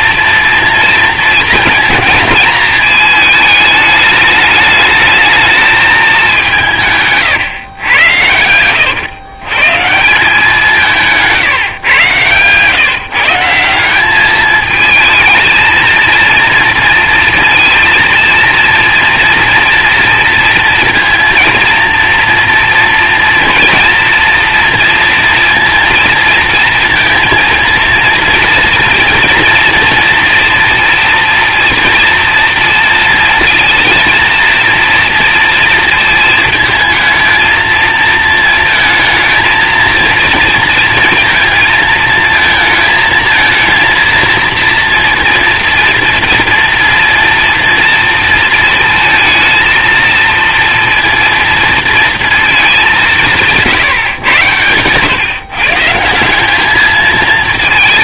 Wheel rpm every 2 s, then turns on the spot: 230, 220, 210, 180, 100, 180, 130, 220, 230, 230, 230, 230, 230, 230, 230, 230, 230, 230, 230, 220, 230, 220, 230, 230, 230, 230, 220, 130, 200.
none